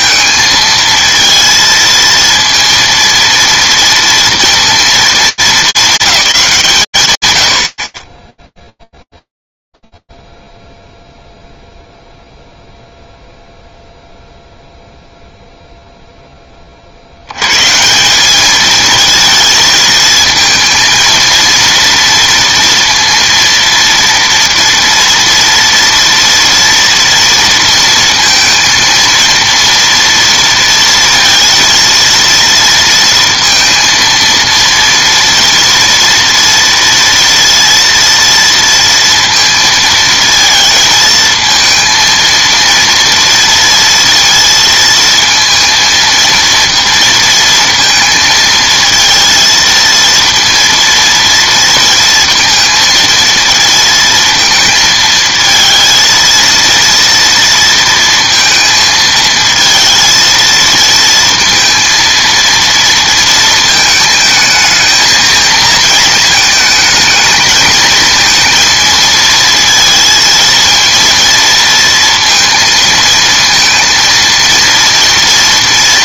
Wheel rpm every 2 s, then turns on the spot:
220, 230, 230, 180, 0, 0, 0, 0, 50, 220, 230, 230, 230, 230, 230, 230, 230, 230, 230, 230, 220, 230, 230, 230, 230, 230, 220, 220, 230, 230, 230, 230, 220, 220, 230, 230, 230, 230.
none